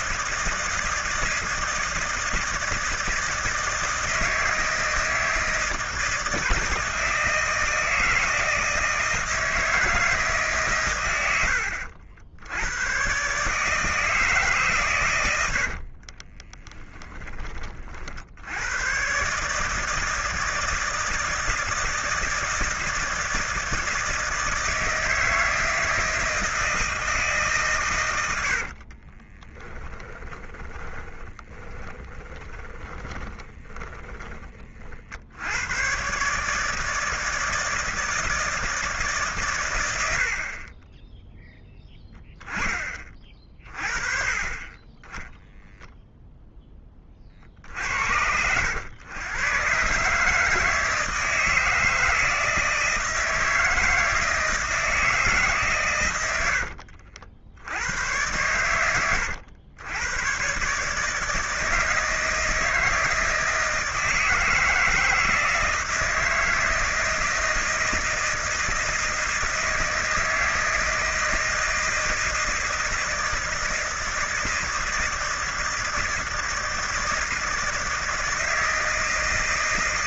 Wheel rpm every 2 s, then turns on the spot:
160, 160, 160, 160, 160, 140, 90, 140, 10, 90, 160, 160, 160, 160, 70, 10, 20, 30, 160, 160, 30, 20, 20, 10, 90, 160, 160, 160, 90, 110, 130, 160, 160, 160, 160, 160, 160, 160, 160, 160.
16-18 28-34 56-58